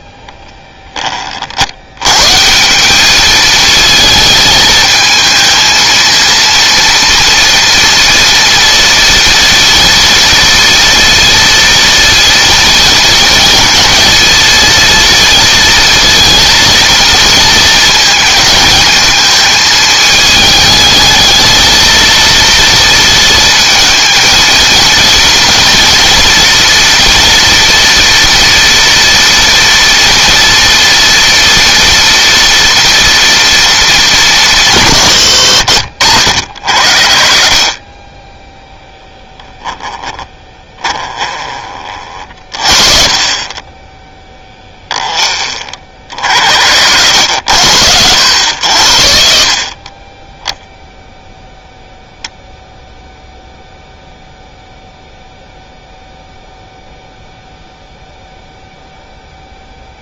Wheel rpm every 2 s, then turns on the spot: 20, 180, 220, 230, 230, 230, 230, 230, 230, 220, 220, 230, 220, 230, 230, 230, 240, 140, 50, 0, 10, 20, 10, 40, 40, 0, 0, 0, 0, 0.
none